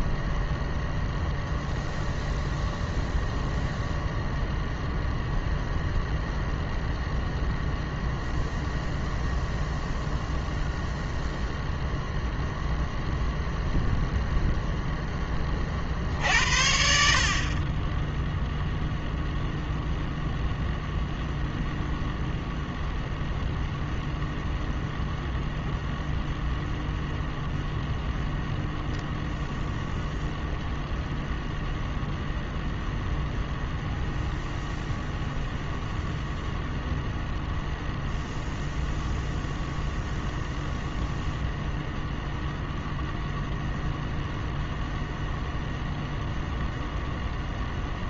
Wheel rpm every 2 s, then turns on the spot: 0, 0, 0, 0, 0, 0, 0, 0, 60, 0, 0, 0, 0, 0, 0, 0, 0, 0, 0, 0, 0, 0, 0, 0.
none